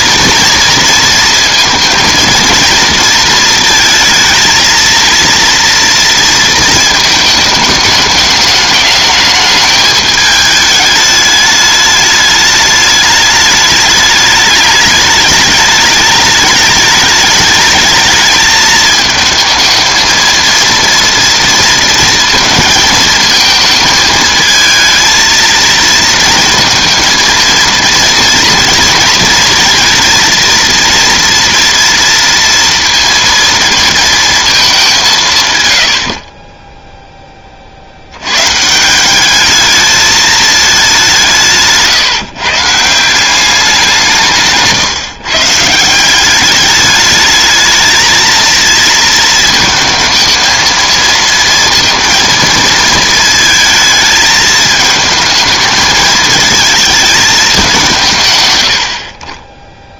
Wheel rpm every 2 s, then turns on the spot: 230, 230, 230, 230, 210, 210, 210, 210, 210, 220, 230, 230, 220, 230, 230, 230, 230, 210, 10, 150, 210, 160, 150, 200, 220, 220, 220, 220, 220, 100.
none